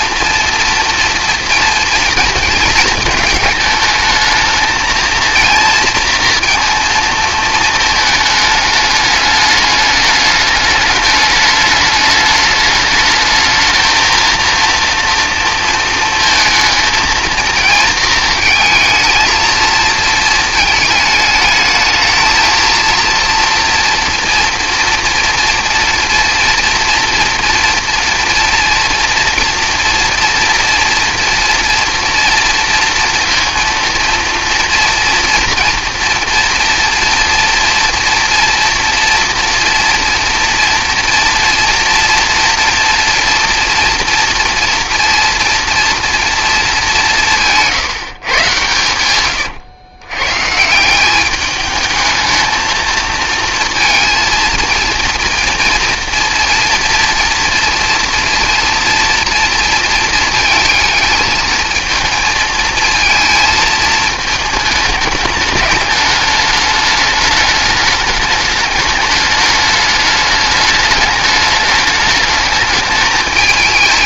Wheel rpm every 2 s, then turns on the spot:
230, 220, 220, 230, 210, 210, 210, 230, 230, 220, 220, 230, 240, 240, 230, 230, 230, 230, 230, 230, 230, 230, 240, 210, 110, 170, 220, 220, 230, 230, 220, 230, 210, 210, 210, 210, 210.
none